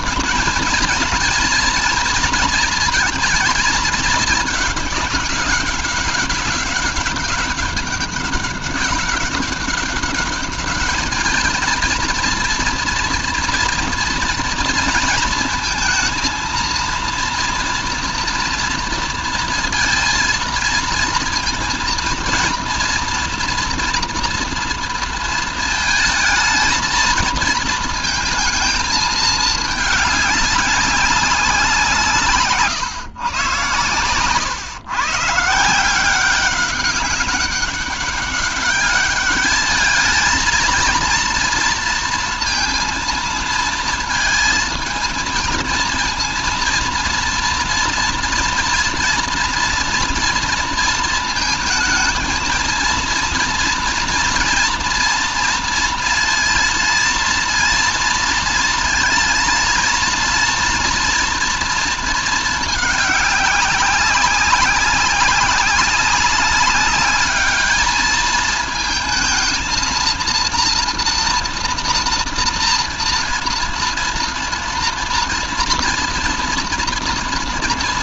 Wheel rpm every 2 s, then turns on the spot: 230, 230, 210, 200, 190, 210, 230, 230, 230, 230, 230, 230, 230, 220, 220, 200, 140, 120, 190, 200, 230, 230, 220, 230, 230, 230, 230, 230, 230, 230, 230, 210, 190, 200, 220, 230, 230, 230, 230.
none